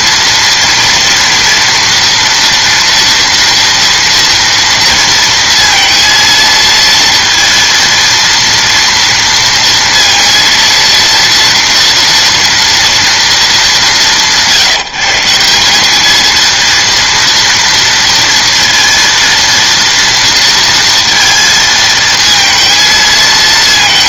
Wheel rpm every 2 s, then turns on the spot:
230, 240, 230, 230, 230, 230, 230, 170, 220, 230, 230, 230.
none